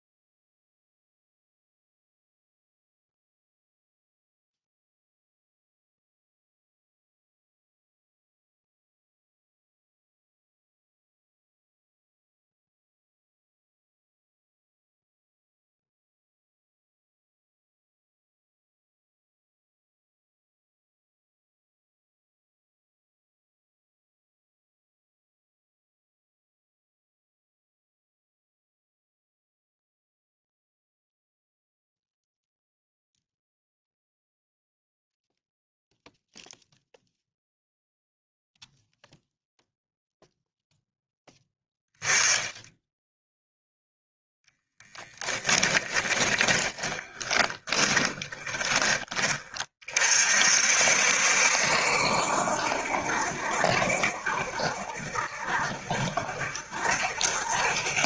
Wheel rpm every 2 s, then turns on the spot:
0, 0, 0, 0, 0, 0, 0, 0, 0, 0, 0, 0, 0, 0, 0, 0, 0, 0, 0, 0, 0, 10, 10, 20, 20, 60, 70, 70, 70.
44-48